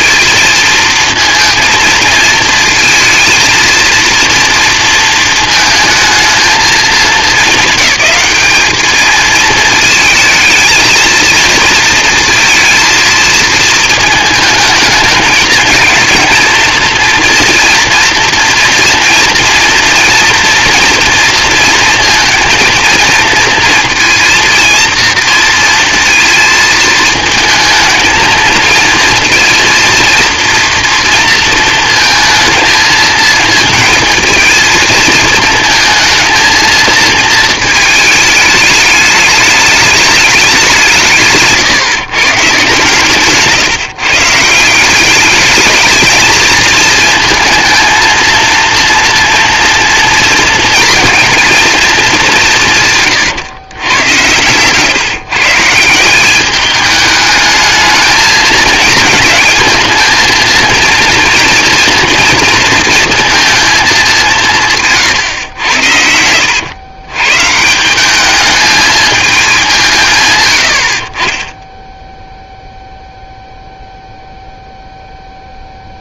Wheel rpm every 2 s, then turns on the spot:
220, 220, 230, 220, 210, 220, 220, 220, 230, 230, 230, 230, 230, 220, 230, 230, 230, 230, 230, 210, 190, 140, 170, 220, 230, 230, 160, 120, 200, 220, 230, 230, 170, 110, 220, 90, 0, 0.
none